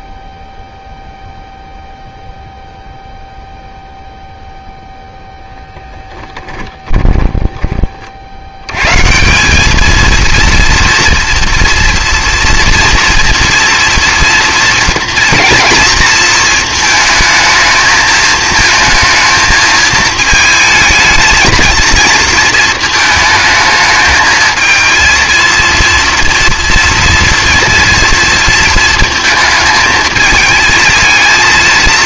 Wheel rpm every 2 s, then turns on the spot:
0, 0, 0, 10, 140, 230, 230, 230, 220, 220, 220, 220, 230, 240, 230, 220.
6-8